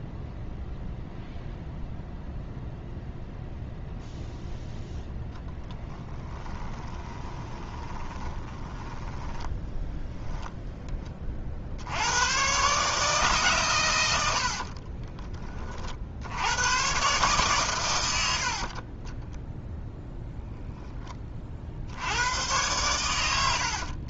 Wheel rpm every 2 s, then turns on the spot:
0, 0, 0, 20, 10, 10, 140, 40, 110, 60, 10, 100.
6-10 14-16 18-20